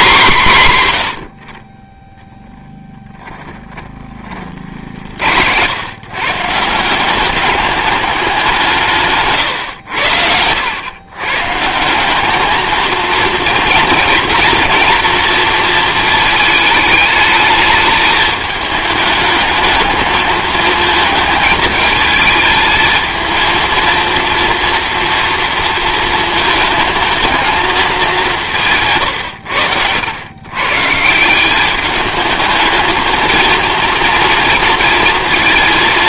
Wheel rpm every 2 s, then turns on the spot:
130, 10, 60, 170, 170, 110, 220, 230, 220, 220, 220, 220, 240, 220, 170, 140, 220, 230.
2-4